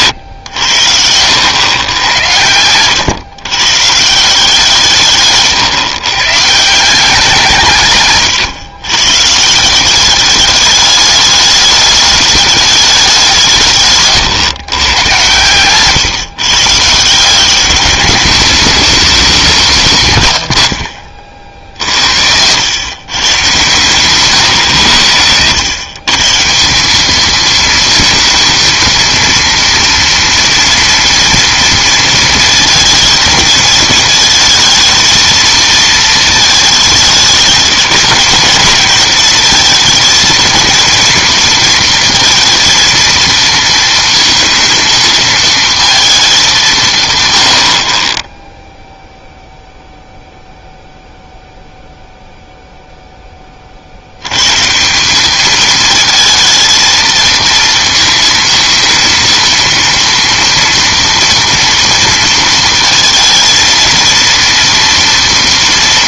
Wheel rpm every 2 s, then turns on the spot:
90, 100, 160, 160, 130, 210, 210, 120, 140, 210, 90, 100, 120, 170, 230, 230, 230, 230, 220, 210, 230, 230, 230, 190, 0, 0, 0, 130, 220, 230, 230, 230, 230.
20-22